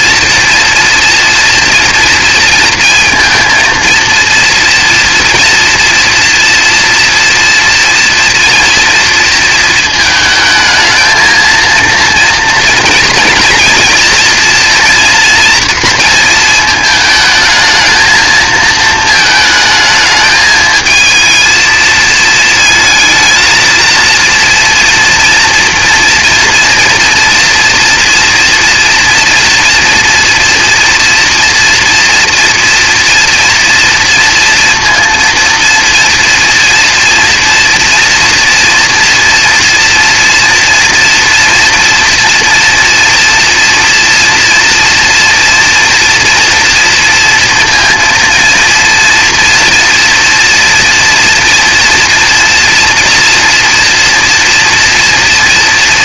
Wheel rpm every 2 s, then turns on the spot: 230, 230, 230, 230, 230, 220, 230, 230, 220, 220, 220, 230, 230, 230, 230, 230, 230, 230, 230, 230, 230, 230, 230, 230, 230, 230, 240, 230.
none